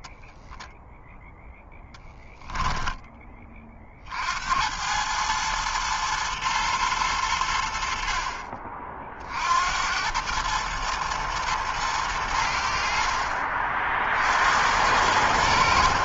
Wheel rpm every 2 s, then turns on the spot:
0, 10, 50, 110, 50, 100, 100, 60.
none